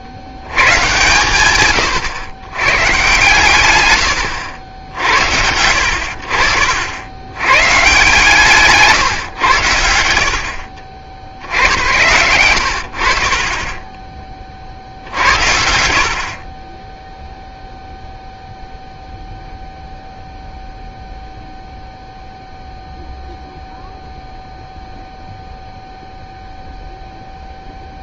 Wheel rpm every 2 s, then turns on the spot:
70, 130, 80, 70, 150, 40, 90, 50, 10, 0, 0, 0, 0, 0.
none